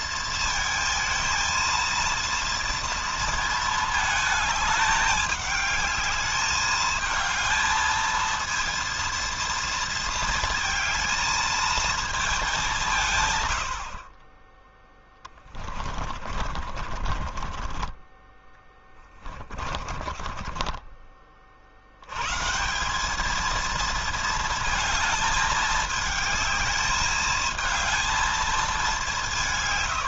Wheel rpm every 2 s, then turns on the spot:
220, 230, 210, 220, 230, 220, 160, 10, 40, 30, 30, 200, 220, 220, 190.
14-20